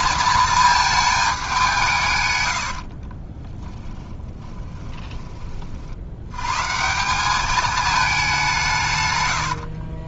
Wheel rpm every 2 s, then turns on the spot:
220, 70, 10, 150, 170.
2-6